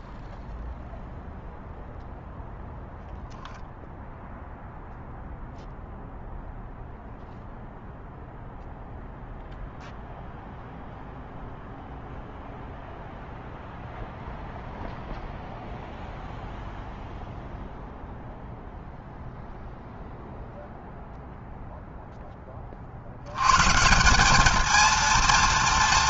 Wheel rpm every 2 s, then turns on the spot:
0, 0, 0, 0, 0, 0, 0, 0, 0, 0, 0, 100, 230.
none